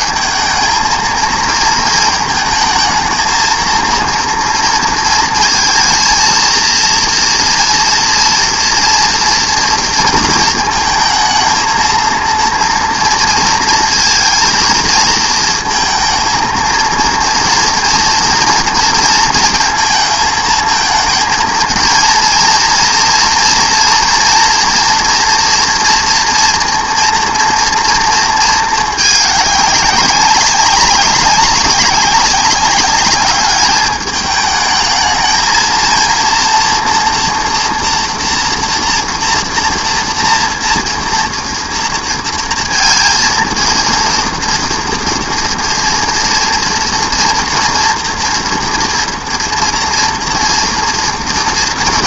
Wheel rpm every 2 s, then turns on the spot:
220, 220, 230, 230, 240, 220, 230, 230, 230, 230, 220, 230, 230, 230, 220, 200, 200, 220, 230, 230, 230, 230, 240, 230, 240, 240.
none